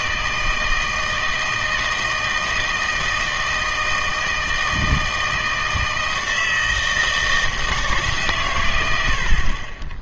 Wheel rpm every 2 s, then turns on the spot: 160, 160, 160, 160, 120.
none